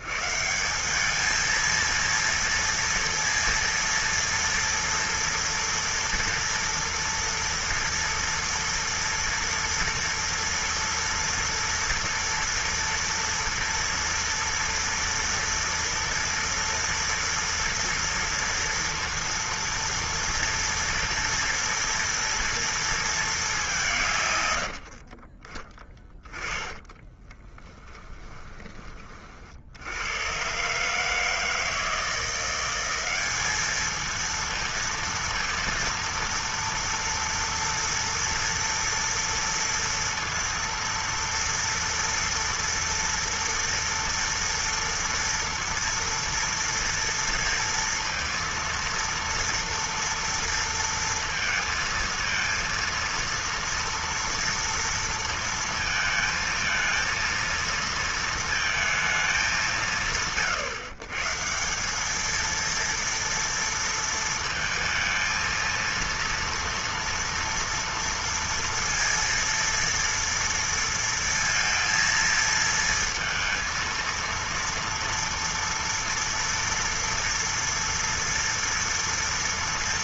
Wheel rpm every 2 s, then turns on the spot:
130, 230, 230, 230, 230, 230, 230, 230, 230, 230, 230, 230, 160, 20, 10, 100, 170, 220, 230, 230, 230, 230, 230, 230, 230, 230, 230, 230, 220, 230, 140, 220, 230, 230, 230, 230, 230, 230, 240, 230.
26-30